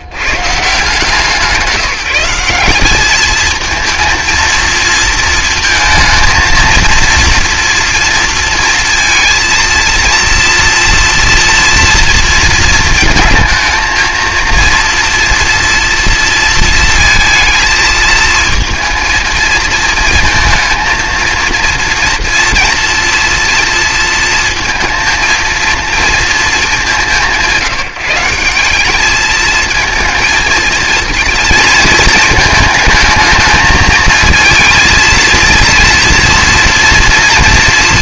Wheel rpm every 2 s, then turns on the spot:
150, 190, 230, 230, 230, 230, 230, 230, 220, 220, 230, 230, 230, 210, 190, 220, 220, 230, 240.
none